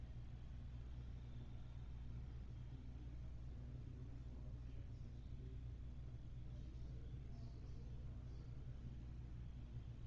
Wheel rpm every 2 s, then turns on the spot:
0, 0, 0, 0, 0.
none